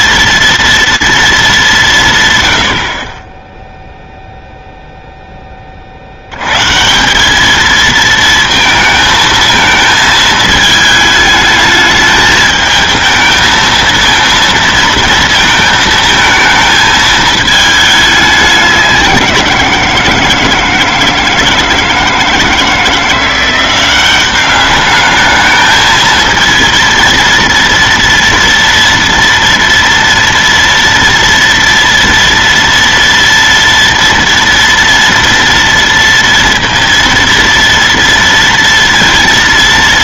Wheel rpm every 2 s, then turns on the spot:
230, 70, 0, 140, 230, 220, 220, 230, 220, 190, 160, 160, 200, 230, 230, 230, 230, 230, 230, 230.
none